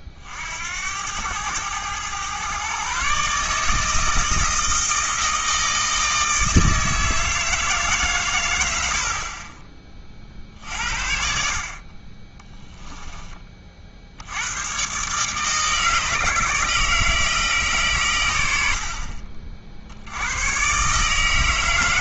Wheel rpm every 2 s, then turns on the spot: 70, 130, 160, 160, 90, 50, 10, 110, 160, 80, 120.
12-14